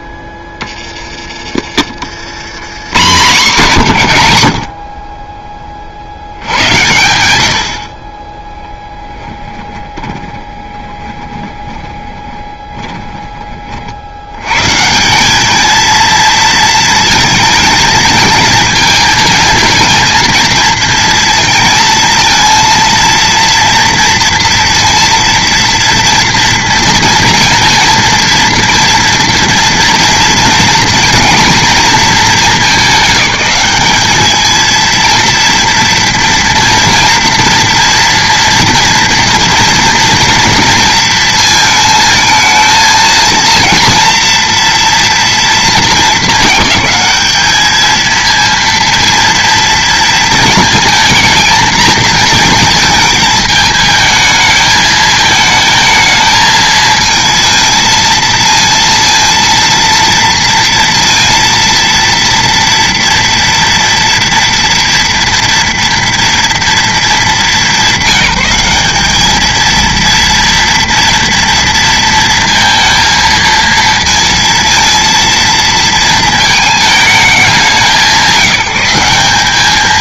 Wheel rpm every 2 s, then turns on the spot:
20, 100, 40, 100, 10, 20, 20, 110, 220, 220, 230, 230, 230, 230, 230, 230, 210, 220, 230, 240, 230, 220, 240, 220, 230, 230, 220, 220, 220, 230, 230, 230, 230, 220, 200, 230, 230, 230, 220, 190.
8-14